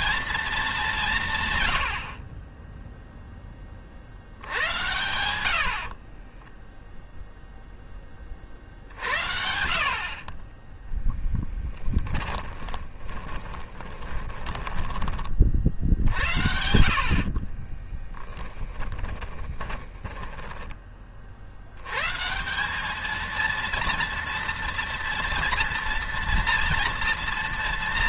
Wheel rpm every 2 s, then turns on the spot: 200, 10, 90, 10, 50, 10, 20, 20, 60, 20, 20, 210, 230, 230.
6-8 12-20